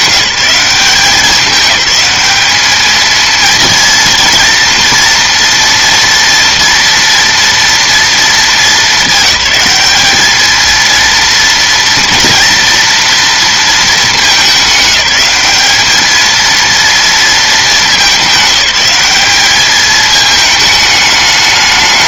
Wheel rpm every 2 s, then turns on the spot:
190, 220, 230, 230, 200, 230, 230, 210, 230, 200, 210.
none